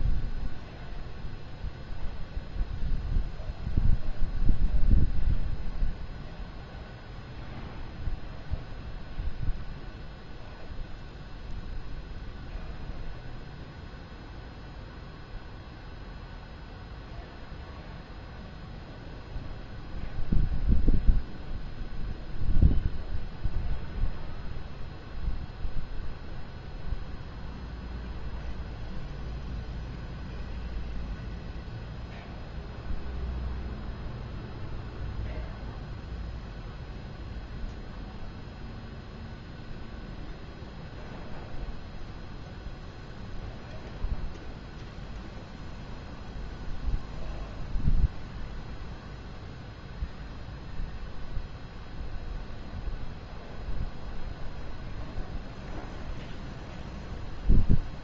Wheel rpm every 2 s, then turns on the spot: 0, 0, 0, 0, 0, 0, 0, 0, 0, 0, 0, 0, 0, 0, 0, 0, 0, 0, 0, 0, 0, 0, 0, 0, 0, 0, 0, 0, 0.
none